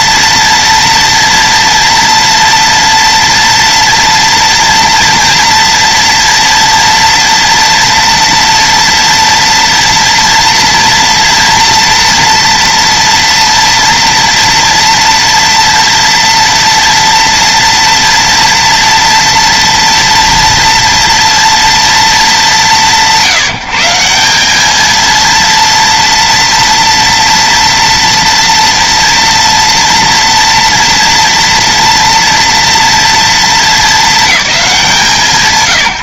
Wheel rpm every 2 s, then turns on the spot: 230, 230, 240, 230, 230, 230, 230, 230, 230, 230, 230, 160, 230, 230, 230, 230, 230, 170.
none